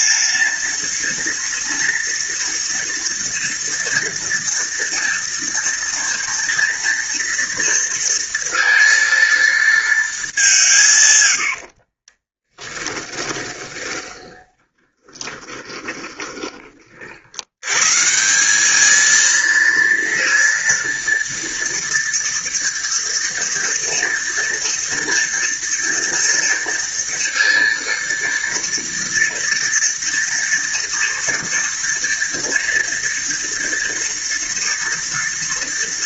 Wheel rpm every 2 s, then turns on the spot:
230, 230, 230, 230, 230, 190, 20, 20, 20, 170, 230, 230, 230, 230, 230, 230, 230, 230.
12-16